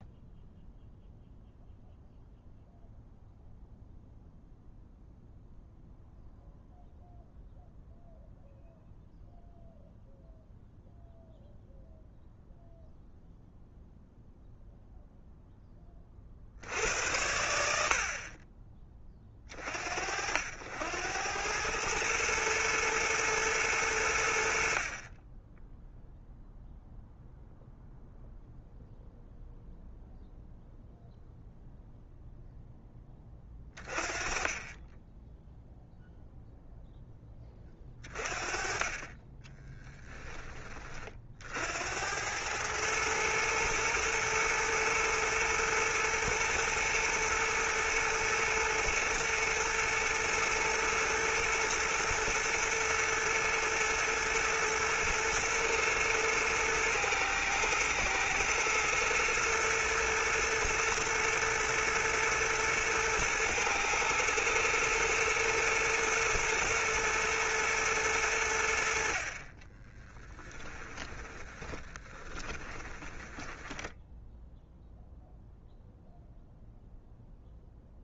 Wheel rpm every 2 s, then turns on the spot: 0, 0, 0, 0, 0, 0, 0, 0, 80, 30, 90, 110, 40, 0, 0, 0, 20, 10, 0, 20, 40, 110, 120, 110, 110, 110, 120, 110, 110, 120, 110, 110, 110, 120, 60, 10, 10, 0, 0.
70-74